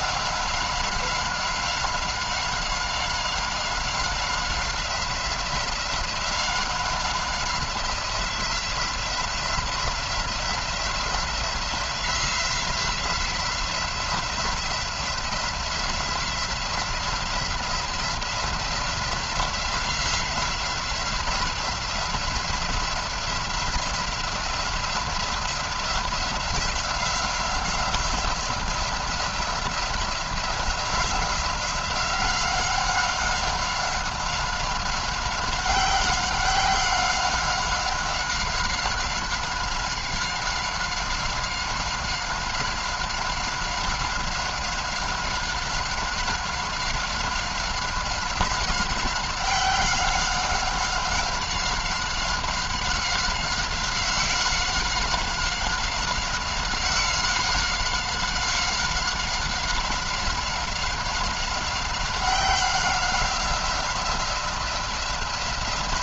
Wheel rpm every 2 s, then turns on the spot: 190, 190, 180, 180, 180, 170, 180, 170, 180, 180, 180, 180, 180, 180, 180, 180, 190, 190, 190, 190, 190, 190, 190, 190, 190, 190, 190, 190, 190, 190, 190, 190, 180.
none